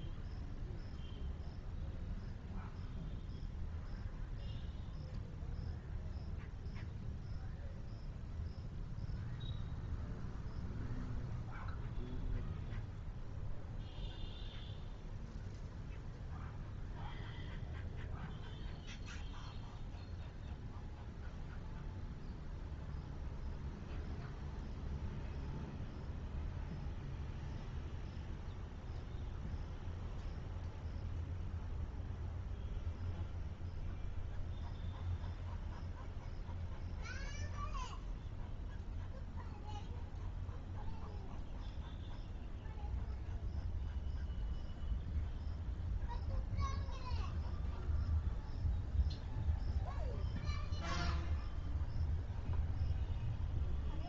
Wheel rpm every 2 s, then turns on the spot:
0, 0, 0, 0, 0, 0, 0, 0, 0, 0, 0, 0, 0, 0, 0, 0, 0, 0, 0, 0, 0, 0, 0, 0, 0, 0, 0.
none